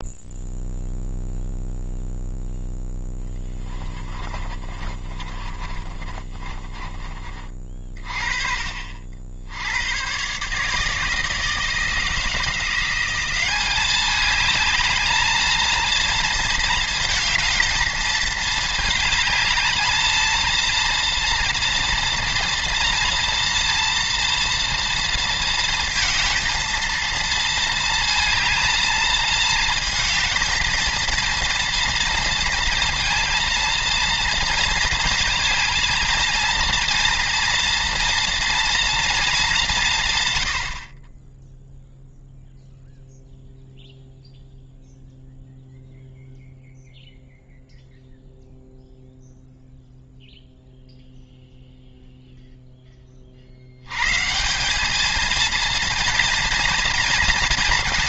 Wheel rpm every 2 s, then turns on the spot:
0, 0, 40, 30, 50, 150, 180, 220, 220, 220, 230, 230, 230, 230, 220, 230, 230, 230, 230, 230, 60, 0, 0, 0, 0, 0, 10, 200, 230.
4-8